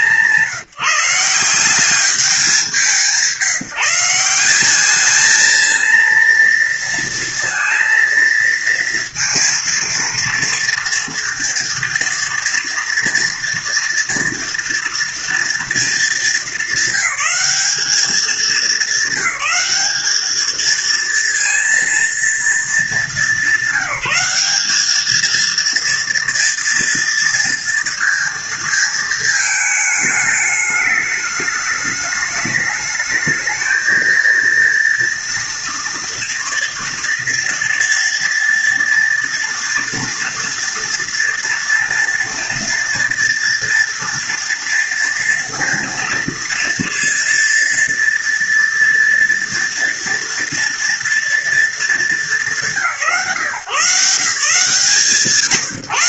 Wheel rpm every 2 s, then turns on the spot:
160, 200, 190, 230, 230, 230, 230, 230, 210, 200, 220, 220, 200, 240, 230, 210, 210, 230, 230, 230, 230, 230, 230, 230, 230, 230, 170, 150.
none